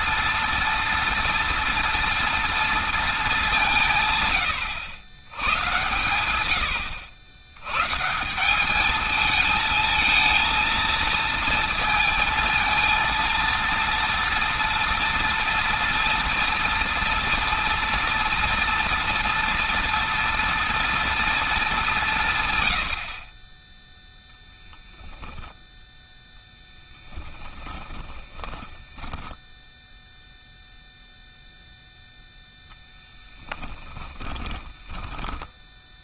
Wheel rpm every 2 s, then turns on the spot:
240, 230, 110, 80, 200, 230, 230, 230, 230, 230, 230, 100, 10, 10, 20, 0, 0, 20.
24-26 28-30 34-36